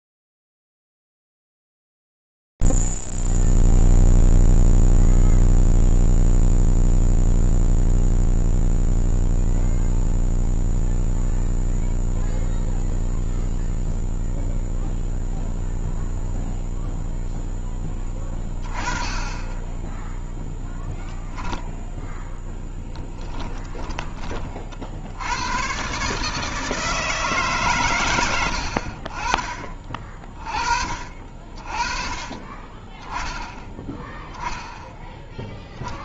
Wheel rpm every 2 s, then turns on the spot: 0, 0, 0, 0, 0, 0, 0, 0, 0, 10, 0, 10, 50, 150, 90, 30, 20, 10.
22-24